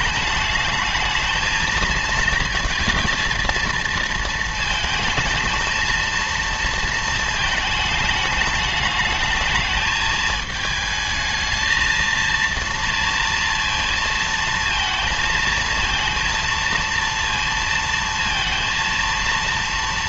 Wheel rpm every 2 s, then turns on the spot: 210, 220, 220, 230, 210, 220, 230, 230, 230, 230.
none